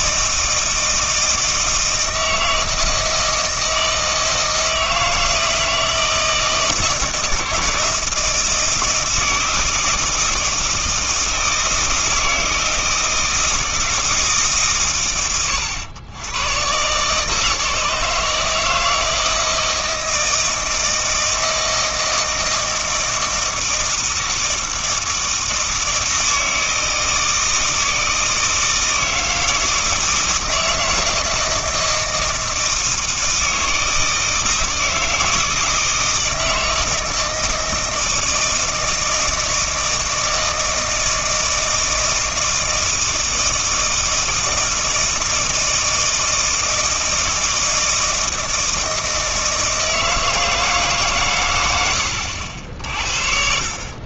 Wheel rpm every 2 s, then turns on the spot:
160, 160, 160, 160, 160, 160, 160, 130, 120, 160, 160, 160, 160, 160, 160, 160, 160, 160, 160, 160, 160, 160, 160, 160, 160, 160, 70.
52-54